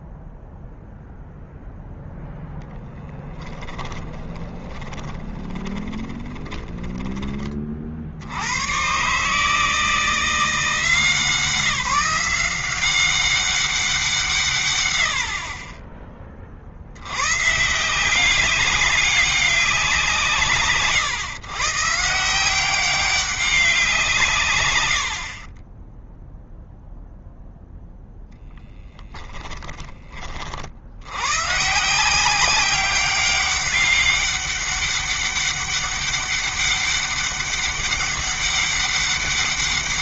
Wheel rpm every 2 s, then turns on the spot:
0, 10, 20, 20, 120, 170, 190, 90, 100, 200, 140, 190, 90, 0, 10, 90, 190, 200, 200, 200.
2-8 24-26 28-30